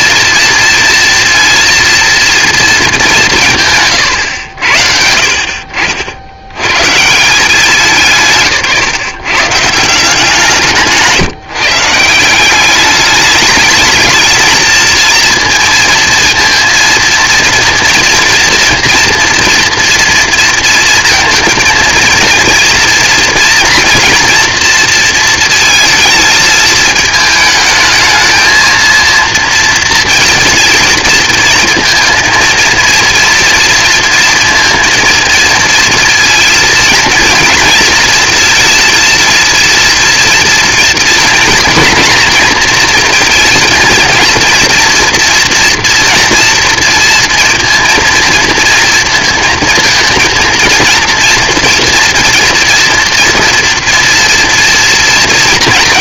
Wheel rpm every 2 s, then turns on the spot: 230, 220, 90, 90, 150, 170, 190, 220, 230, 230, 230, 230, 230, 220, 230, 230, 230, 230, 220, 230, 230, 240, 230, 230, 230, 230, 230, 230.
none